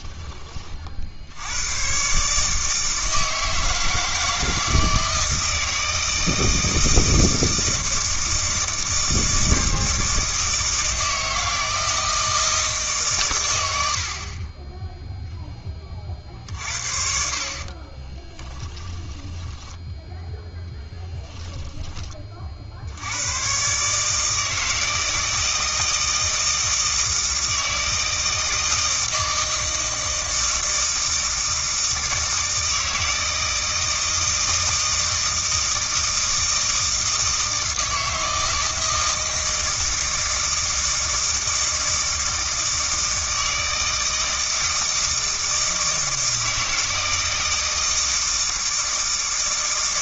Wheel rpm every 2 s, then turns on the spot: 40, 160, 160, 160, 160, 160, 150, 10, 50, 20, 10, 60, 160, 160, 160, 160, 160, 160, 160, 160, 160, 160, 160, 160, 160.
18-20